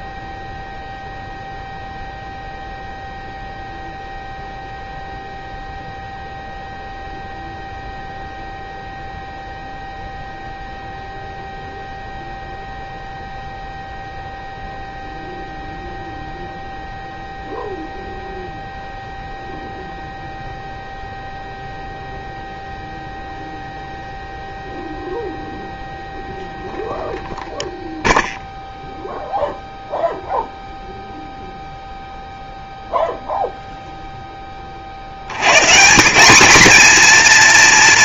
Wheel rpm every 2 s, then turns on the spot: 0, 0, 0, 0, 0, 0, 0, 0, 0, 0, 0, 0, 0, 0, 0, 0, 0, 40, 220.
none